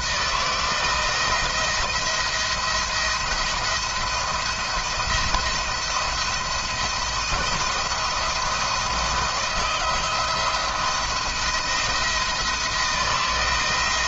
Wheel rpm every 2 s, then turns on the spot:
170, 170, 170, 170, 160, 160, 170.
none